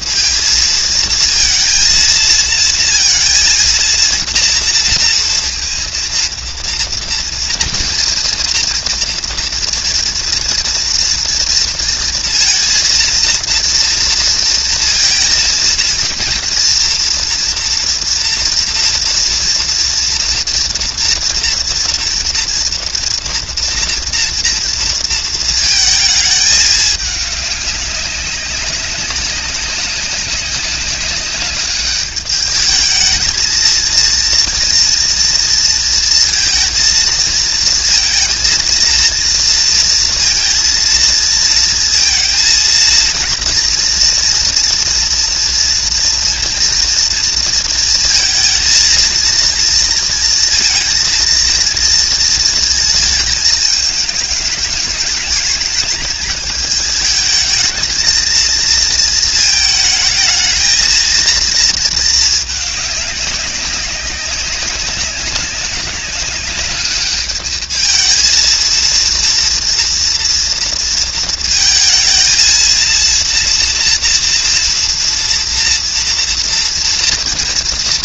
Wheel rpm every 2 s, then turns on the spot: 230, 230, 230, 230, 230, 230, 230, 230, 230, 230, 230, 230, 230, 210, 200, 200, 210, 230, 230, 230, 230, 230, 230, 230, 230, 230, 230, 220, 220, 230, 220, 220, 200, 200, 230, 230, 230, 230, 230.
none